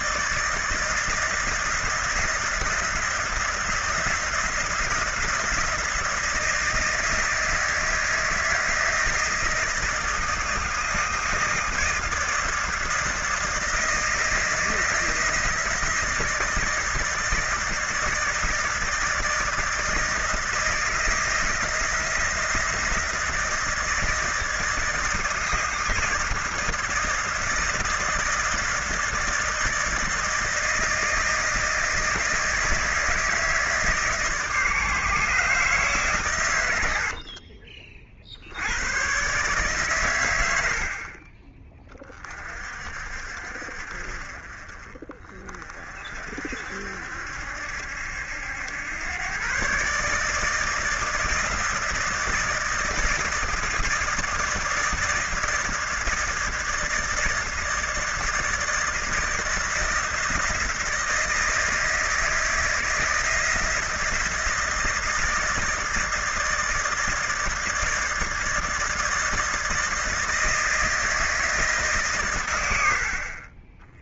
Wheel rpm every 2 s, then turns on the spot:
160, 170, 170, 160, 160, 160, 160, 160, 160, 160, 160, 170, 160, 160, 170, 160, 160, 150, 110, 80, 90, 40, 40, 60, 90, 160, 160, 160, 160, 160, 160, 160, 160, 160, 160, 160, 110.
none